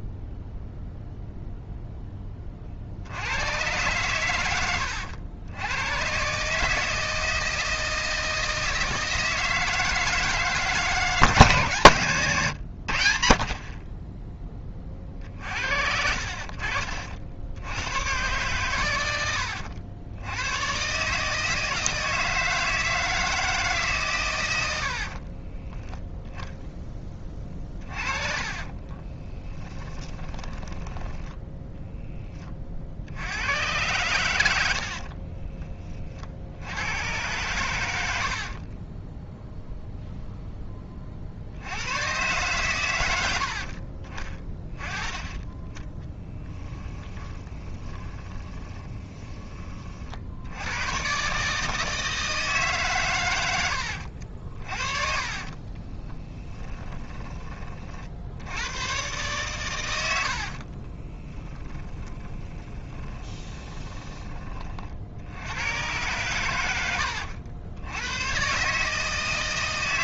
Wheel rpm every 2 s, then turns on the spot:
0, 60, 90, 160, 160, 160, 90, 40, 50, 100, 130, 160, 70, 10, 30, 20, 60, 60, 100, 20, 20, 100, 20, 20, 20, 110, 140, 50, 20, 110, 40, 20, 50, 100, 140.
24-26 28-32 34-36 38-40 44-50 54-58 60-64